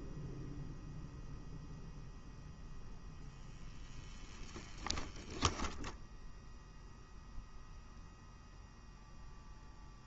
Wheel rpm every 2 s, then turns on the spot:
0, 0, 10, 0, 0.
none